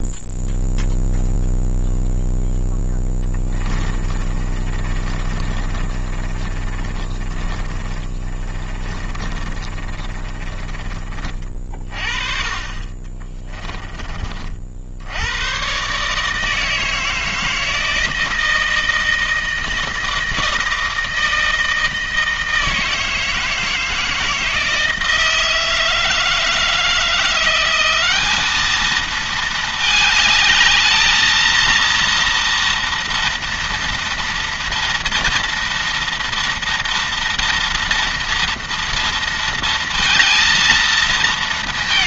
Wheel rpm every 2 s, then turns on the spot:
0, 10, 30, 30, 30, 30, 30, 70, 160, 160, 160, 160, 160, 170, 220, 210, 230, 230, 230, 230, 220.
2-10 12-14